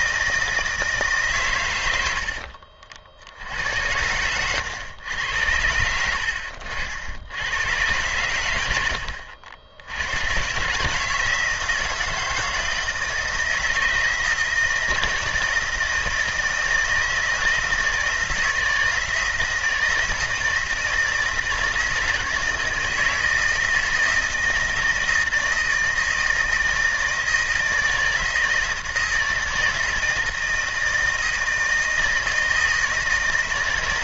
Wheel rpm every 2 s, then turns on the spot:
150, 60, 100, 70, 80, 150, 160, 160, 160, 160, 160, 160, 160, 160, 160, 160, 160.
none